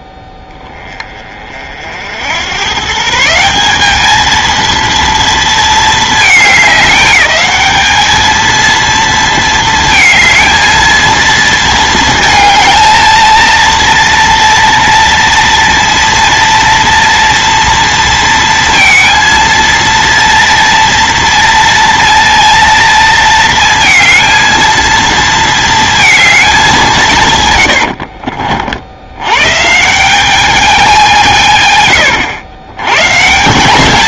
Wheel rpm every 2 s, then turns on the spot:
10, 110, 230, 210, 220, 220, 220, 230, 230, 230, 230, 230, 230, 200, 50, 200, 100.
none